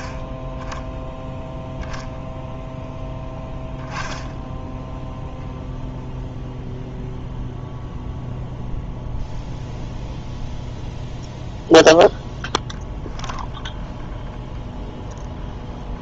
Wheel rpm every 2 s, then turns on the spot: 10, 0, 0, 0, 0, 0, 0, 0.
none